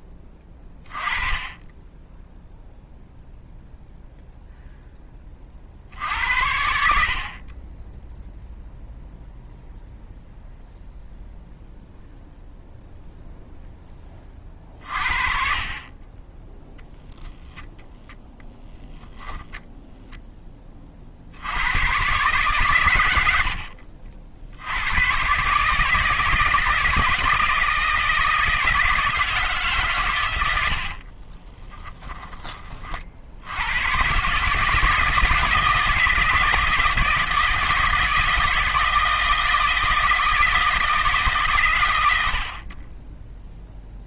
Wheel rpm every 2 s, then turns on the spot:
20, 0, 0, 80, 0, 0, 0, 30, 10, 0, 20, 130, 80, 160, 160, 90, 20, 150, 160, 160, 160, 60.
none